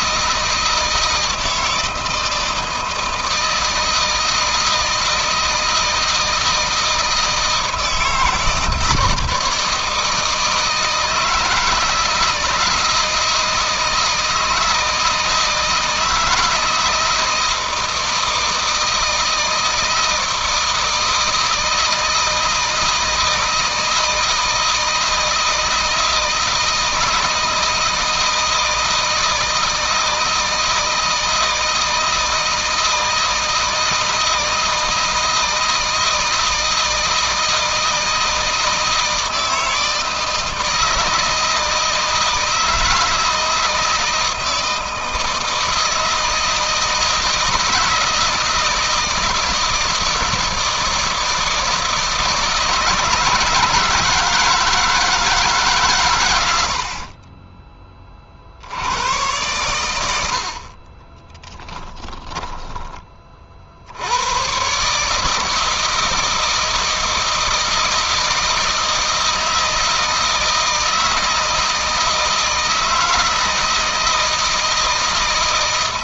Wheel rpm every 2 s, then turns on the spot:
160, 160, 160, 160, 160, 160, 160, 160, 170, 160, 160, 160, 160, 160, 160, 160, 160, 160, 160, 160, 160, 160, 160, 160, 160, 160, 150, 160, 60, 90, 30, 30, 140, 160, 160, 160, 160, 160.
60-62